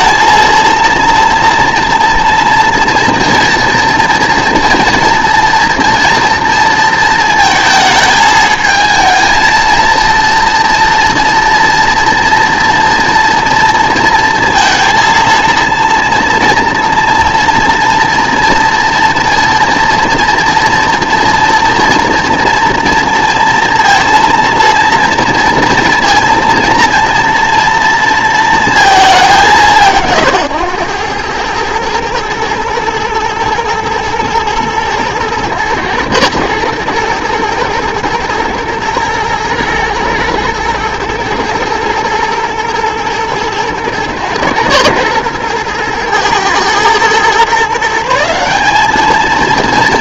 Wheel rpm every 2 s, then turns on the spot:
230, 230, 230, 230, 220, 230, 230, 230, 230, 230, 230, 230, 230, 230, 230, 120, 120, 110, 120, 110, 110, 110, 120, 110, 200.
none